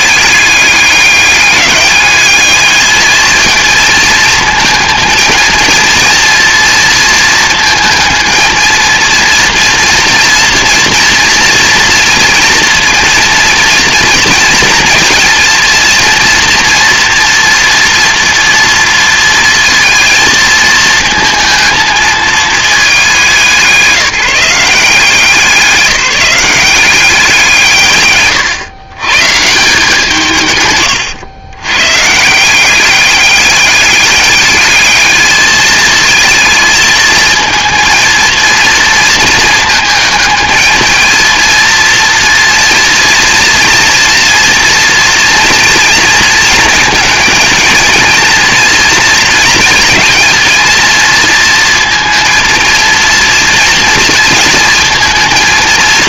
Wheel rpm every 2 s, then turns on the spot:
200, 210, 220, 230, 230, 230, 230, 230, 230, 230, 220, 200, 180, 190, 120, 130, 190, 210, 220, 230, 220, 240, 230, 220, 230, 230, 230, 230.
none